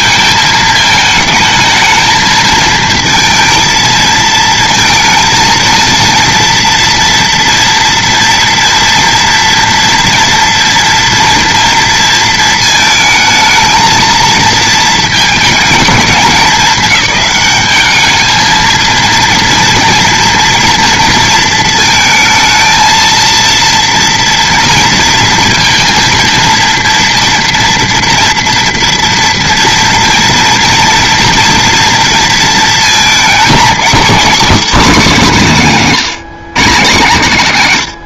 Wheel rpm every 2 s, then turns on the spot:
220, 230, 220, 230, 230, 230, 230, 230, 210, 230, 230, 220, 230, 230, 230, 230, 220, 240, 170.
none